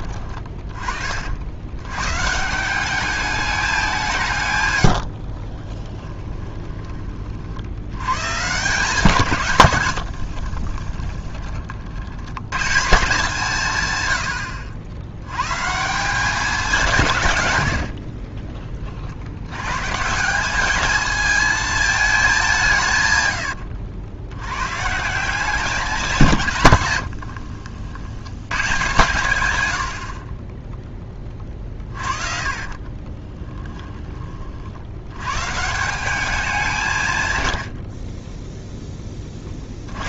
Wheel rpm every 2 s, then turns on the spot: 40, 200, 100, 20, 160, 30, 160, 80, 180, 40, 210, 140, 150, 120, 120, 10, 40, 80, 170, 10.
4-6 10-12 32-34